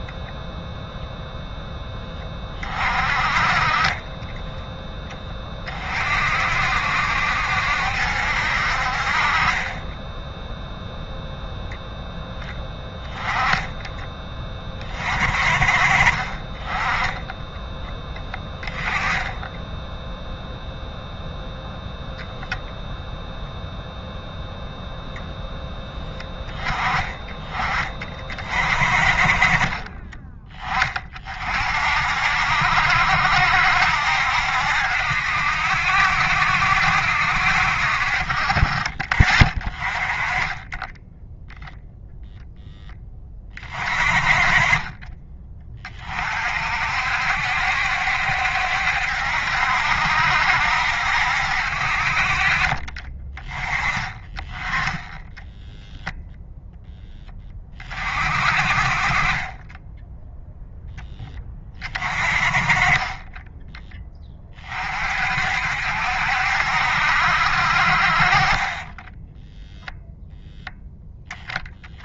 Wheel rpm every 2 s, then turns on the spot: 0, 30, 10, 60, 60, 0, 10, 30, 20, 10, 0, 0, 0, 10, 40, 20, 70, 70, 70, 40, 10, 10, 20, 50, 70, 70, 40, 10, 0, 40, 0, 20, 30, 70, 20, 10.
52-54